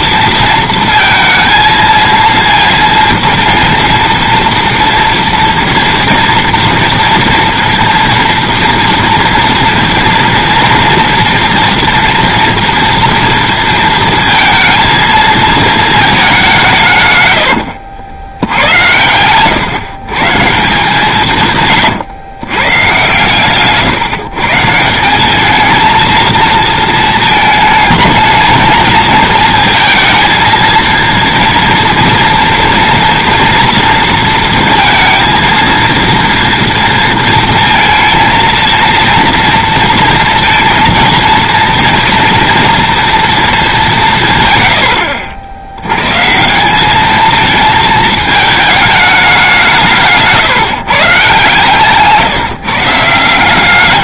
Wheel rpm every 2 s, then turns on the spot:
230, 230, 230, 230, 230, 230, 230, 220, 180, 100, 160, 120, 160, 220, 220, 220, 230, 230, 230, 230, 230, 240, 120, 180, 220, 150, 150.
none